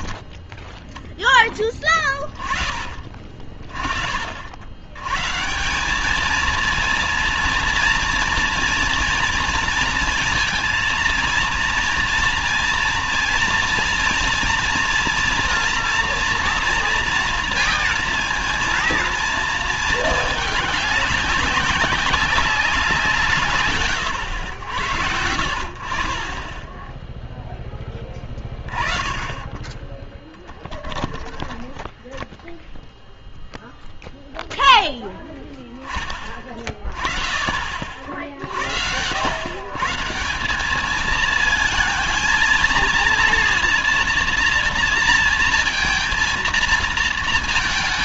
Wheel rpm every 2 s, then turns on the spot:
10, 20, 70, 220, 240, 230, 240, 230, 230, 230, 200, 190, 90, 20, 20, 30, 10, 0, 20, 70, 180, 230, 230, 230.
30-32